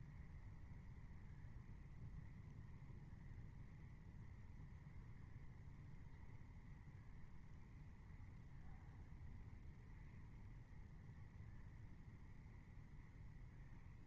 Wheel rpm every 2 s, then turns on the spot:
0, 0, 0, 0, 0, 0, 0.
none